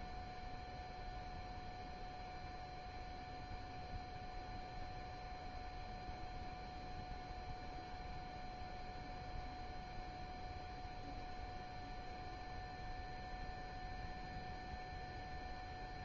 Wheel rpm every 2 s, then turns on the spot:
0, 0, 0, 0, 0, 0, 0, 0.
none